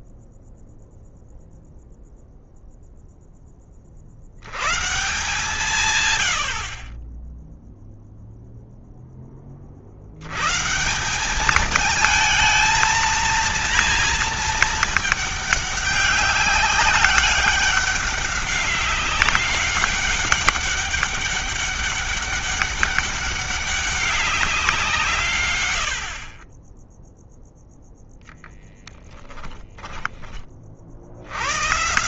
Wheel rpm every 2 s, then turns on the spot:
0, 0, 120, 40, 0, 150, 230, 220, 200, 200, 200, 200, 180, 20, 0, 30.
none